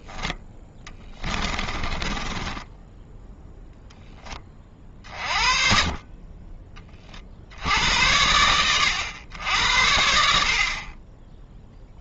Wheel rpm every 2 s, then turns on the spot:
10, 10, 30, 30, 100, 60.
0-4